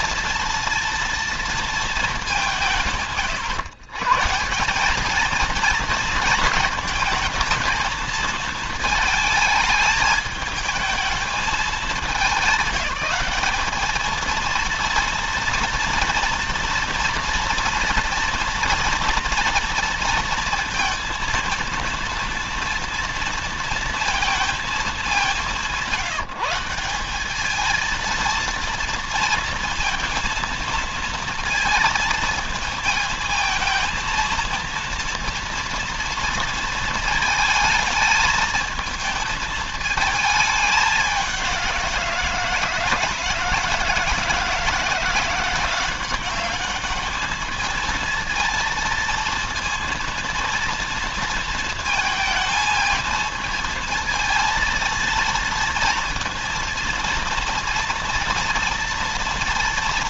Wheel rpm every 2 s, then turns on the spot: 230, 140, 210, 220, 220, 220, 200, 230, 230, 230, 230, 230, 200, 190, 230, 230, 220, 230, 230, 220, 200, 160, 170, 210, 230, 230, 220, 230, 230, 230.
none